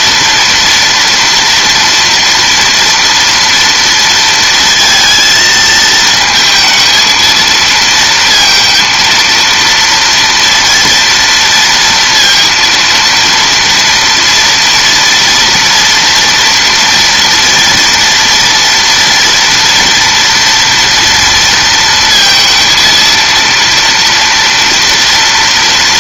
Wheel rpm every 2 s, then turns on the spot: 230, 230, 230, 220, 230, 230, 230, 240, 230, 230, 230, 230, 230.
none